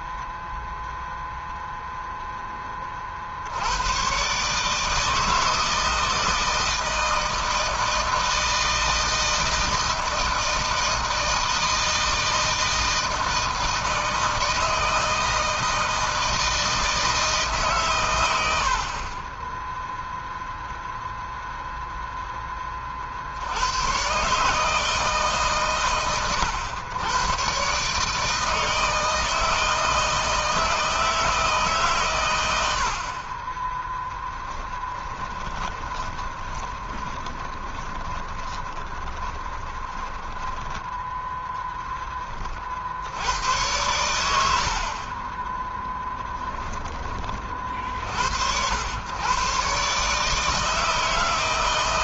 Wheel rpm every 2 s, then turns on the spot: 0, 30, 150, 160, 160, 160, 160, 160, 160, 40, 0, 30, 150, 110, 160, 160, 60, 10, 20, 20, 10, 60, 50, 20, 90, 160.
34-40